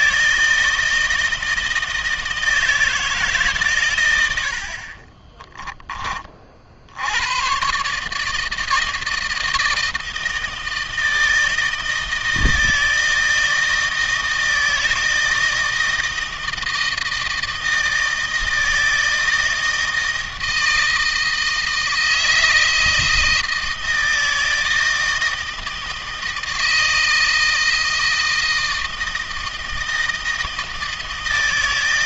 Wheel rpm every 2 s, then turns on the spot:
160, 160, 40, 70, 160, 160, 160, 160, 160, 160, 160, 160, 160, 160, 160, 160.
4-6